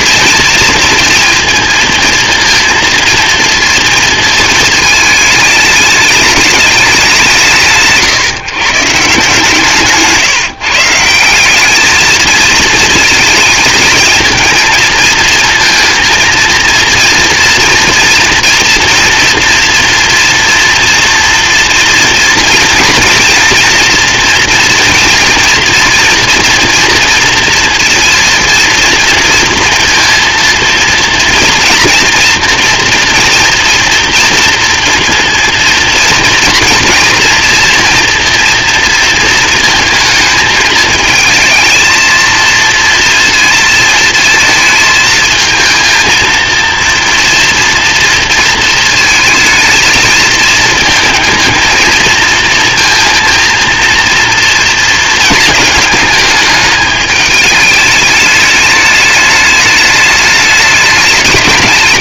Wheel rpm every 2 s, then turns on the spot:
230, 230, 220, 190, 150, 160, 220, 230, 230, 230, 230, 230, 230, 230, 230, 230, 230, 230, 230, 230, 220, 230, 220, 230, 220, 230, 230, 230, 210, 210, 210.
none